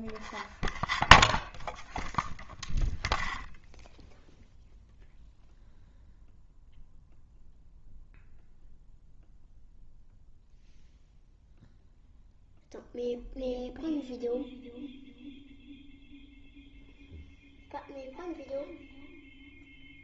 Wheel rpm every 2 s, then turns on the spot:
0, 0, 0, 0, 0, 0, 0, 0, 0, 0.
none